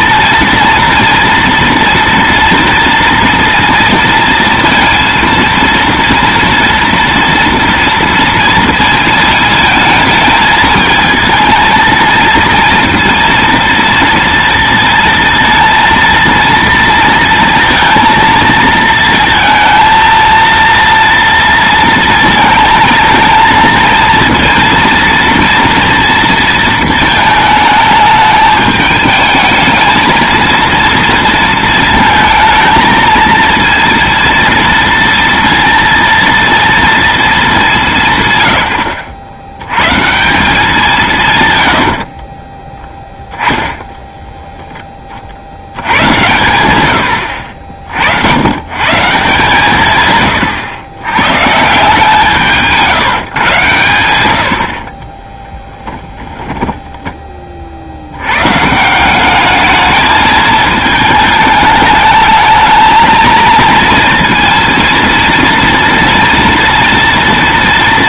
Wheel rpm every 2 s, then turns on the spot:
230, 230, 230, 230, 230, 220, 230, 230, 230, 230, 230, 230, 230, 220, 210, 230, 220, 230, 230, 90, 190, 30, 10, 100, 120, 100, 160, 70, 10, 150, 220, 220, 230, 230.
42-44 54-58